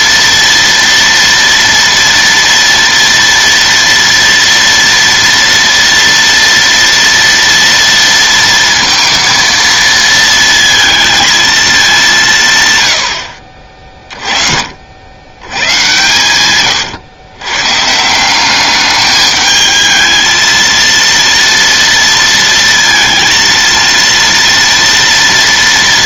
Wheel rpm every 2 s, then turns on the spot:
240, 240, 230, 230, 230, 230, 140, 50, 110, 200, 230, 230, 230.
16-18